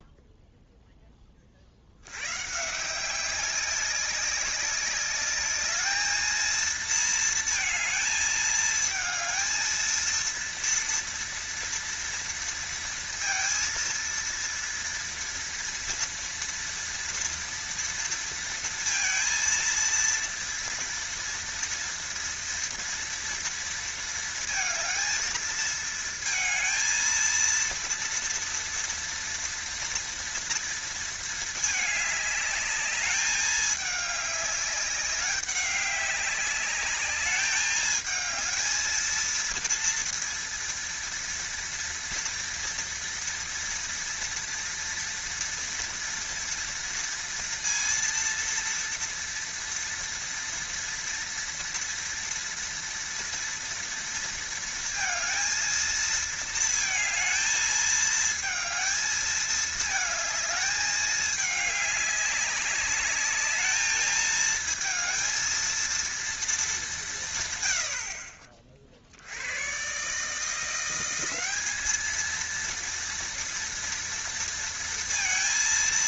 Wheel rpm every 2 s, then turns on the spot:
20, 180, 200, 230, 220, 230, 230, 230, 230, 230, 230, 230, 220, 230, 230, 230, 210, 200, 210, 220, 230, 230, 230, 230, 230, 230, 230, 230, 220, 220, 210, 200, 220, 170, 70, 180, 230, 230.
none